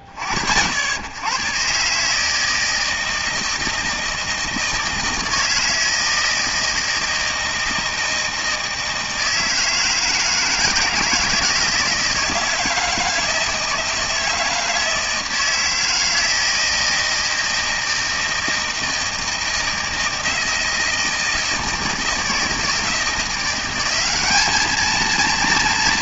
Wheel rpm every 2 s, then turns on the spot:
100, 160, 160, 160, 160, 160, 160, 160, 160, 160, 160, 160, 220.
none